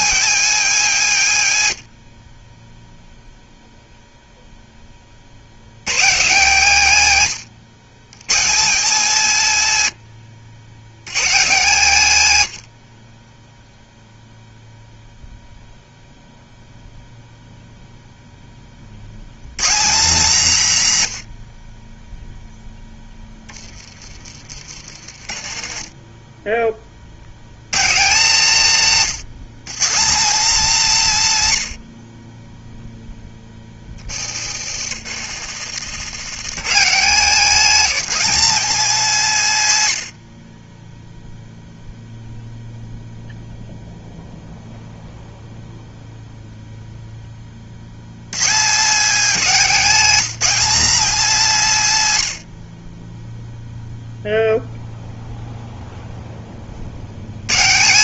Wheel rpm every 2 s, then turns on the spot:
230, 0, 40, 140, 200, 130, 50, 0, 0, 80, 120, 10, 40, 80, 160, 200, 10, 90, 180, 190, 10, 0, 0, 0, 210, 250, 20, 0, 90.
24-26 34-36